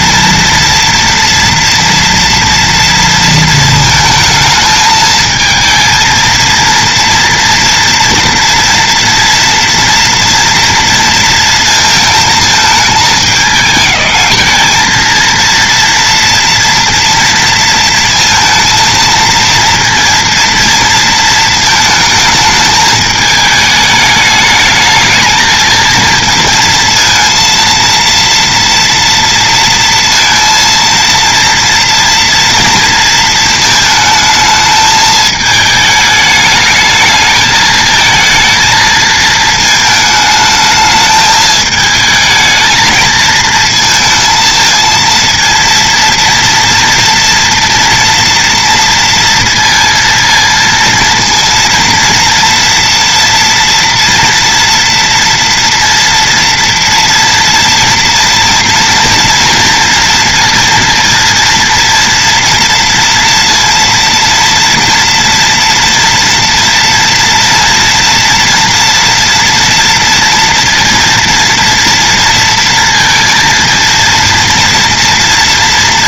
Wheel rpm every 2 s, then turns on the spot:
230, 230, 220, 230, 230, 230, 220, 220, 230, 230, 230, 210, 210, 230, 230, 230, 230, 220, 220, 220, 220, 220, 220, 230, 230, 230, 230, 240, 230, 230, 230, 230, 230, 230, 230, 230, 230, 230.
none